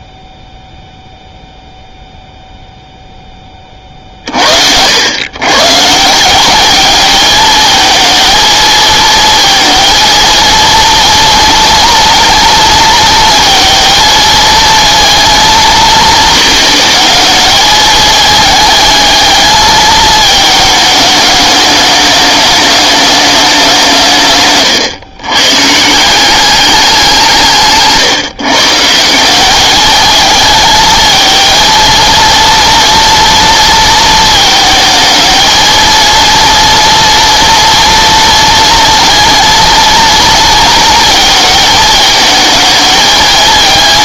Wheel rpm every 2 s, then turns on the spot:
0, 0, 60, 200, 220, 230, 230, 230, 220, 220, 220, 210, 140, 190, 140, 220, 230, 220, 230, 230, 230, 220.
24-26